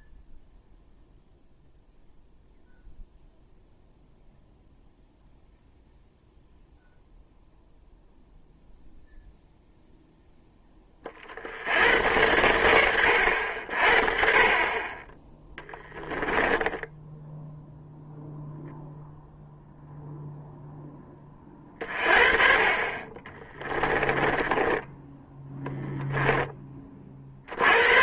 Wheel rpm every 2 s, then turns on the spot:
0, 0, 0, 0, 0, 10, 100, 30, 10, 0, 0, 30, 10, 20.
16-18 24-26